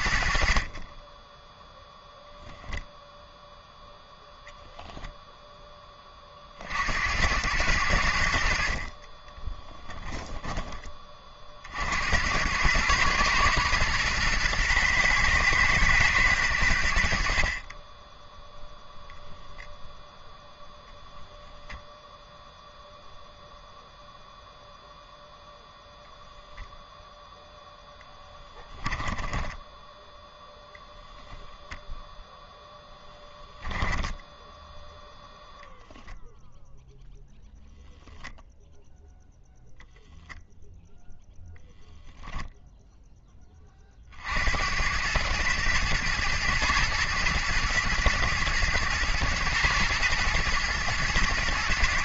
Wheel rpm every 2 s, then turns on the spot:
30, 0, 0, 60, 50, 20, 100, 120, 90, 0, 0, 0, 0, 0, 10, 0, 0, 0, 0, 0, 0, 0, 90, 120, 120, 110.
0-2 28-30